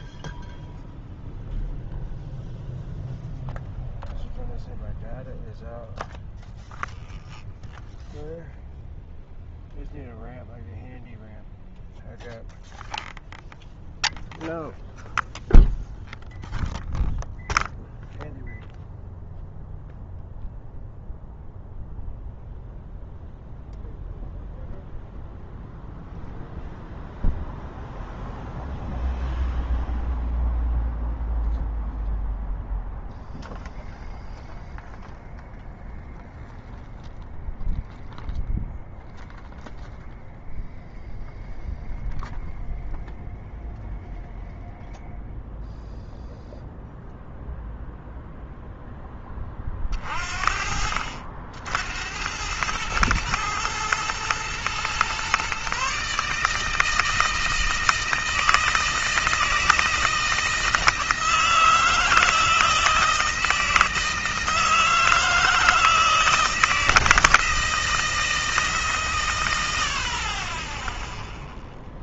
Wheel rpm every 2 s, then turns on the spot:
0, 0, 0, 0, 0, 0, 0, 0, 0, 0, 0, 0, 0, 0, 0, 0, 0, 0, 0, 0, 0, 0, 0, 0, 20, 60, 110, 130, 160, 160, 160, 160, 160, 160, 120, 0.
none